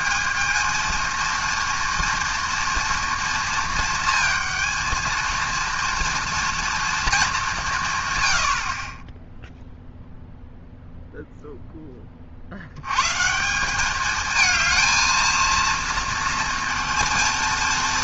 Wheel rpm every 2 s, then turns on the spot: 230, 230, 230, 210, 10, 0, 150, 230, 230.
none